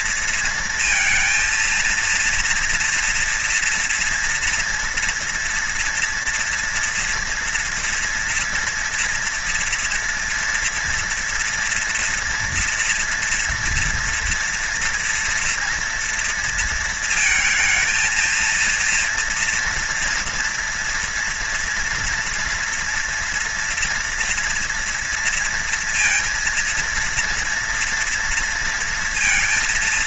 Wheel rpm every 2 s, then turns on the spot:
230, 240, 230, 230, 230, 230, 230, 230, 230, 230, 230, 230, 230, 230, 230.
none